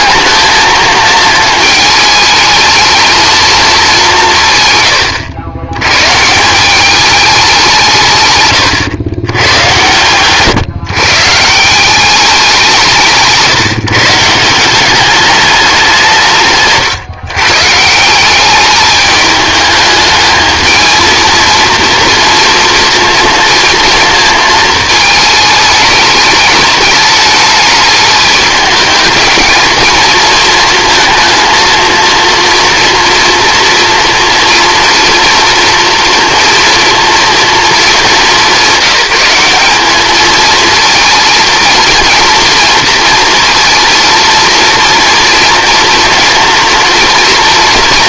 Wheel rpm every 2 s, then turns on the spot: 220, 220, 140, 180, 120, 140, 180, 180, 150, 210, 220, 230, 220, 210, 220, 230, 230, 230, 230, 200, 230, 230, 230, 240.
none